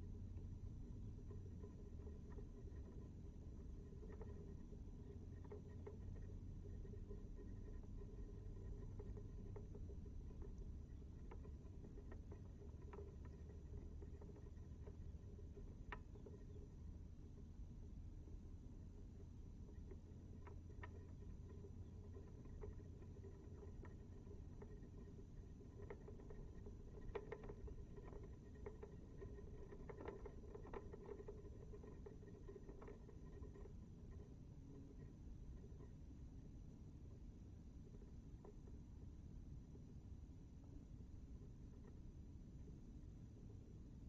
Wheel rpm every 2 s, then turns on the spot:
0, 0, 0, 0, 0, 0, 0, 0, 0, 0, 0, 0, 0, 0, 0, 0, 0, 0, 0, 0, 0, 0.
none